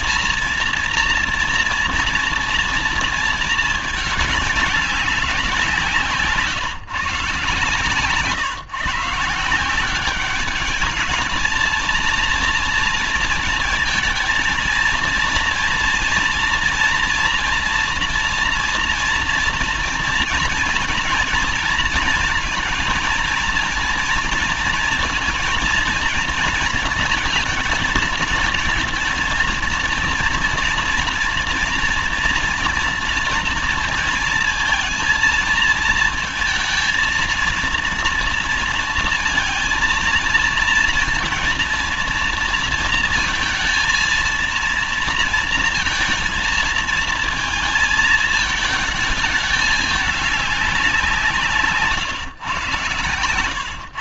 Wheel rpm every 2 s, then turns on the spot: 230, 230, 190, 150, 160, 210, 230, 230, 240, 230, 230, 230, 230, 230, 230, 230, 230, 230, 230, 230, 230, 230, 230, 220, 220, 180, 120.
none